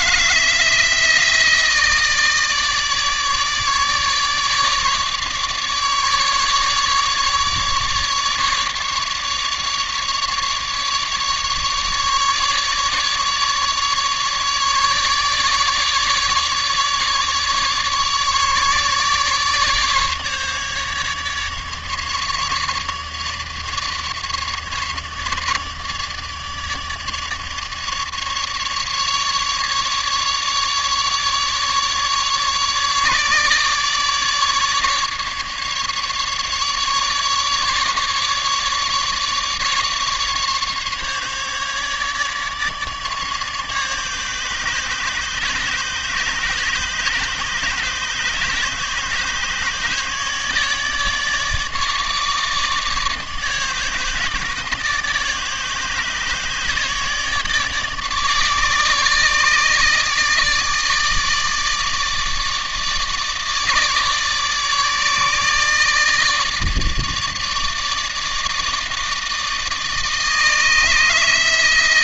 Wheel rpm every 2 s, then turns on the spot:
160, 160, 150, 150, 150, 150, 150, 150, 150, 150, 150, 150, 150, 150, 150, 150, 150, 150, 150, 150, 140, 150, 150, 150, 150, 150, 150, 150, 150, 150, 150, 160, 150, 150, 150, 160.
none